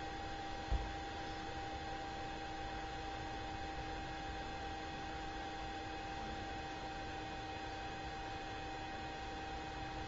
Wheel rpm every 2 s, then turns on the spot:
0, 0, 0, 0, 0.
none